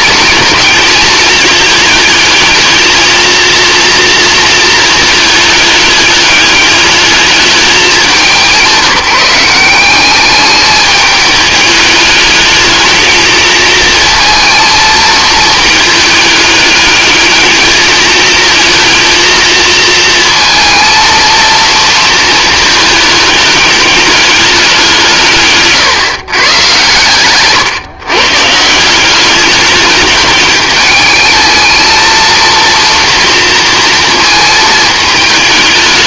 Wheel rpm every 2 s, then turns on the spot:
220, 220, 220, 210, 180, 210, 220, 220, 210, 220, 230, 220, 180, 120, 180, 210, 230, 220.
none